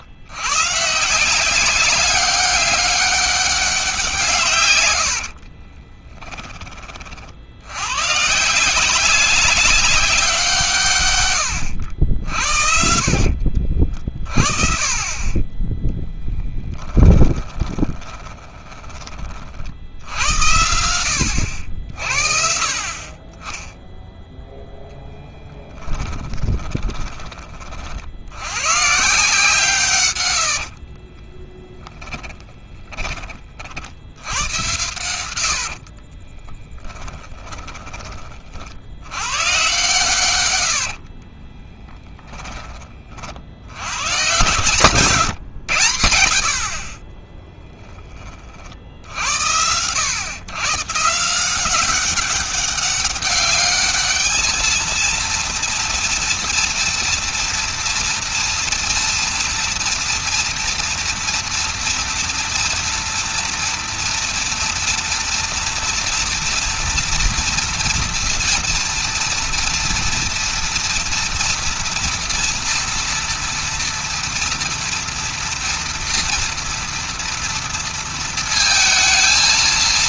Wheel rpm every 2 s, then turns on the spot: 130, 200, 120, 20, 160, 150, 60, 40, 10, 20, 80, 50, 0, 20, 130, 60, 30, 100, 20, 70, 100, 20, 130, 50, 50, 140, 200, 220, 230, 230, 230, 230, 230, 230, 230, 230, 230, 230, 230, 220.
4-6 12-14 16-18 26-28 30-38 40-42